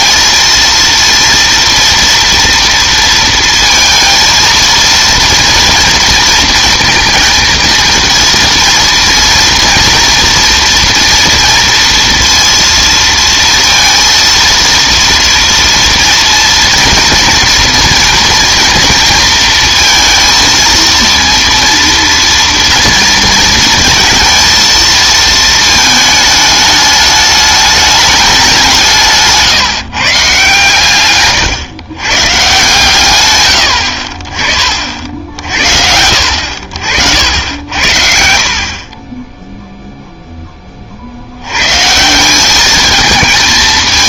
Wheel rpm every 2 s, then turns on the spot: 230, 230, 230, 230, 230, 230, 230, 230, 230, 230, 230, 230, 230, 210, 180, 130, 120, 40, 60, 60, 20, 200.
none